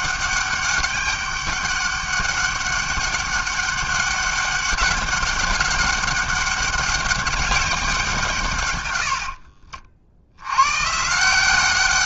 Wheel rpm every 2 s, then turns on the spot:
200, 200, 190, 200, 80, 170.
8-10